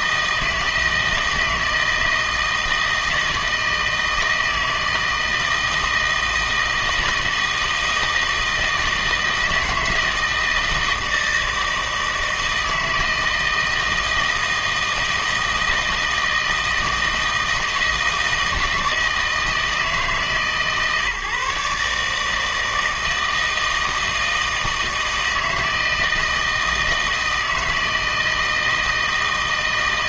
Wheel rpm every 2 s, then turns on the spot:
160, 160, 160, 160, 160, 160, 160, 160, 160, 160, 140, 160, 160, 160, 160.
none